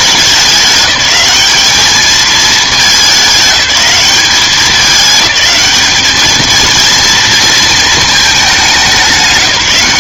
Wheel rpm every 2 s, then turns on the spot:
210, 210, 200, 220, 200.
none